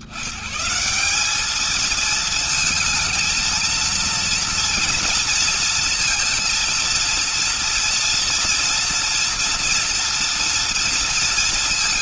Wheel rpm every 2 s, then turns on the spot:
110, 220, 230, 230, 230, 230.
none